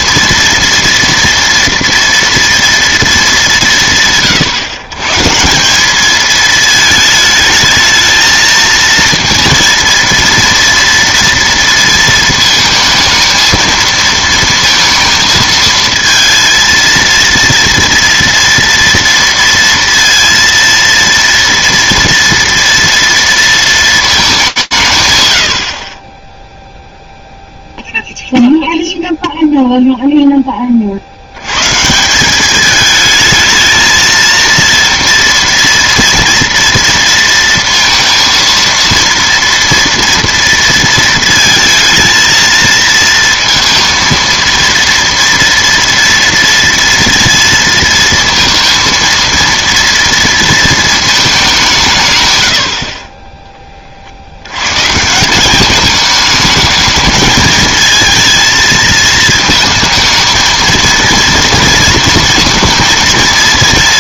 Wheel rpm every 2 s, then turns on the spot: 230, 230, 130, 220, 220, 230, 230, 230, 230, 230, 230, 230, 180, 0, 0, 40, 210, 230, 230, 230, 230, 230, 230, 230, 230, 230, 60, 140, 220, 220, 230, 230.
none